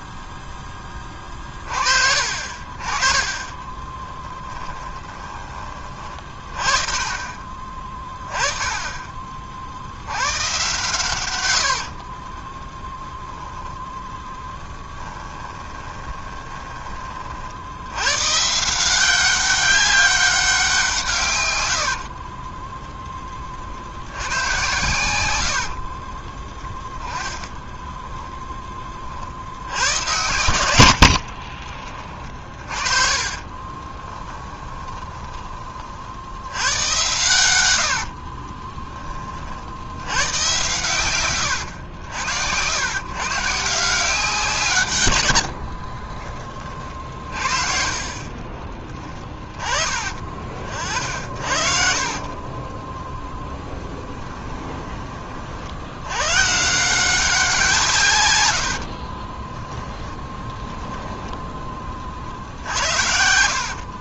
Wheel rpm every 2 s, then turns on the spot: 20, 40, 20, 30, 20, 110, 10, 10, 20, 170, 160, 10, 110, 10, 20, 80, 40, 20, 100, 20, 120, 120, 120, 40, 20, 50, 20, 20, 170, 60, 10, 70.
14-16 24-28 30-36 38-40 48-52 58-62